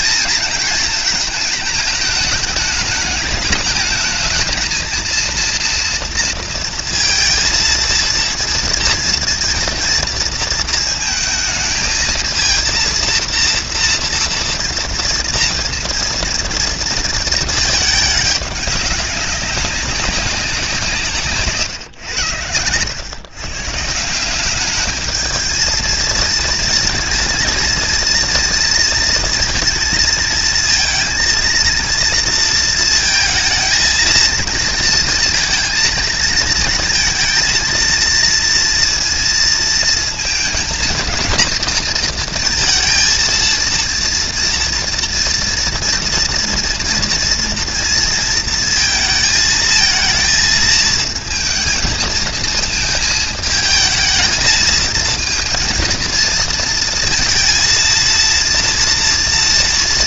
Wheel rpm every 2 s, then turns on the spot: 230, 210, 220, 230, 230, 220, 230, 230, 230, 210, 180, 100, 200, 230, 220, 230, 230, 230, 230, 230, 220, 230, 230, 230, 220, 220, 230, 220, 230, 230.
22-24